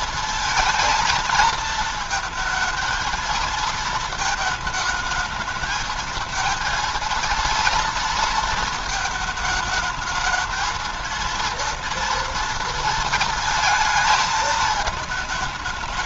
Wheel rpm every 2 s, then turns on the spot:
220, 230, 220, 230, 230, 220, 230, 220.
none